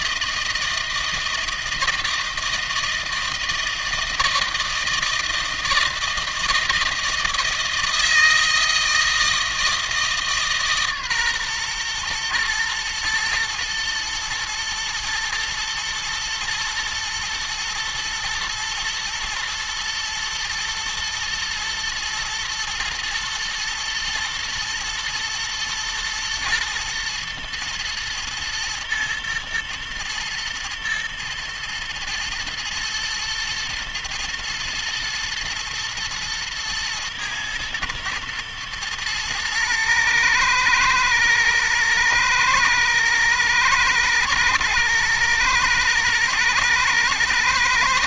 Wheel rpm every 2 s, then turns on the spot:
160, 160, 160, 170, 160, 150, 120, 110, 110, 120, 110, 120, 120, 110, 110, 120, 110, 110, 120, 120, 110, 120, 120, 110.
none